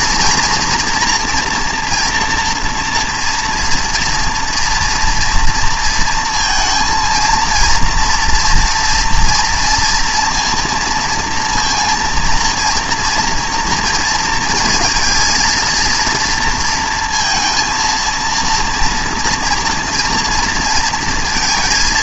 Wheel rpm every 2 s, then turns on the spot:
240, 230, 230, 230, 230, 230, 230, 230, 230, 230, 230.
none